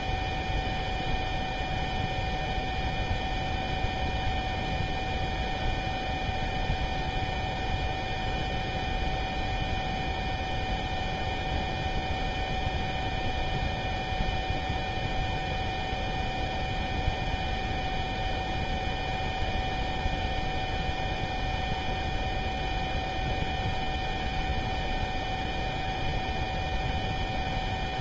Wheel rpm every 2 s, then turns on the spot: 0, 0, 0, 0, 0, 0, 0, 0, 0, 0, 0, 0, 0, 0.
none